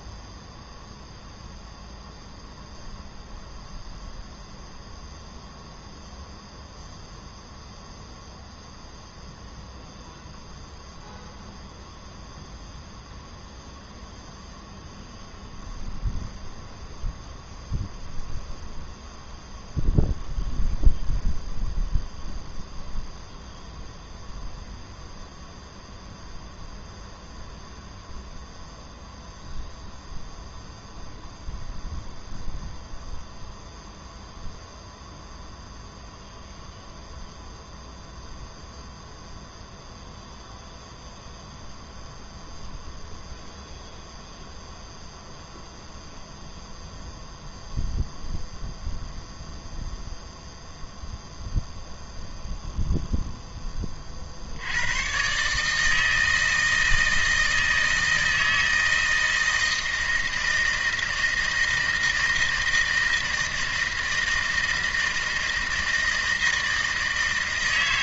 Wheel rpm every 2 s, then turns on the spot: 0, 0, 0, 0, 0, 0, 0, 0, 0, 0, 0, 0, 0, 0, 0, 0, 0, 0, 0, 0, 0, 0, 0, 0, 0, 0, 0, 90, 160, 160, 160, 160, 160, 160.
none